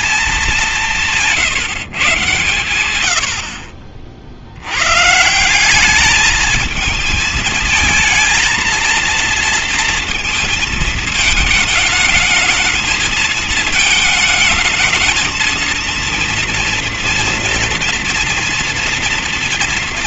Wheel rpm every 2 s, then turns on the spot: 190, 100, 100, 220, 230, 220, 210, 220, 230, 230.
none